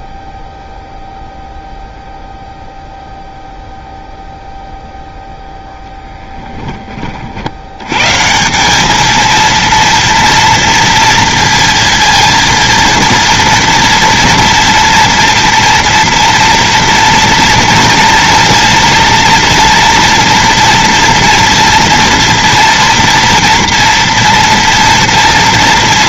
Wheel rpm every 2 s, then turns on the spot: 0, 0, 0, 20, 190, 230, 230, 230, 240, 230, 230, 230, 240.
none